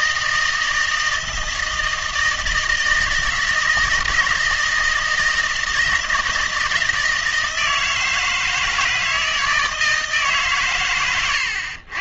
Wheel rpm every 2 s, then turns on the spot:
160, 160, 160, 160, 160, 130.
none